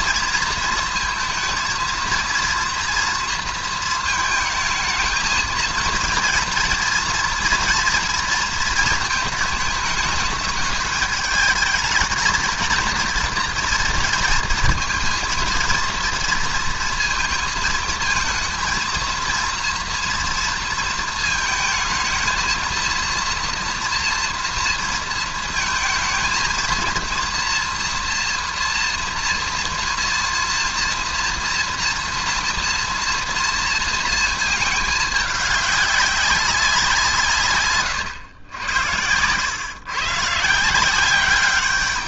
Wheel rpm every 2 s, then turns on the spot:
220, 230, 220, 230, 230, 210, 220, 230, 230, 230, 230, 220, 230, 230, 240, 230, 240, 220, 190, 100, 150.
none